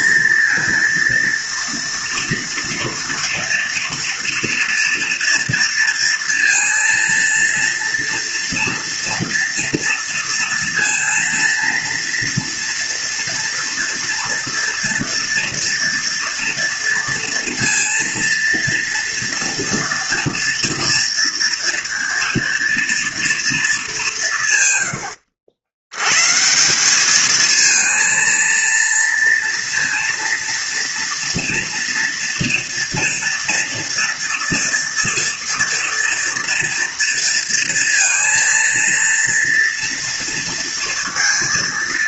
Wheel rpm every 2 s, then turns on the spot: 230, 230, 230, 230, 230, 230, 230, 230, 230, 230, 240, 230, 120, 180, 230, 230, 230, 230, 230, 230, 230.
24-26